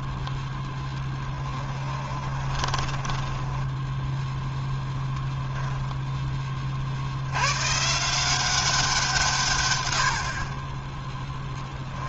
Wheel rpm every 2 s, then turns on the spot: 10, 20, 0, 40, 190, 30.
2-4